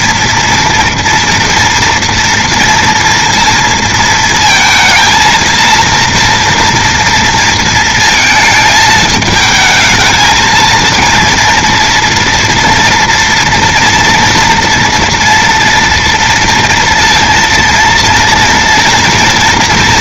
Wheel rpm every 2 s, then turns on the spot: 220, 230, 230, 230, 230, 220, 240, 230, 230, 230.
none